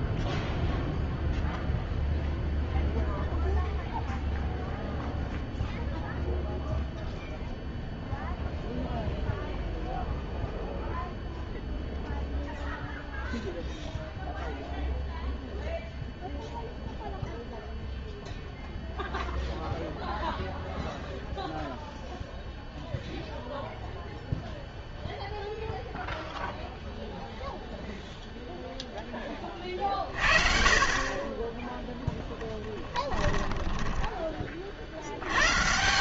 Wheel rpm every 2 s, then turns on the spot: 0, 0, 0, 0, 0, 0, 0, 0, 0, 0, 0, 0, 0, 0, 0, 40, 10, 50.
32-34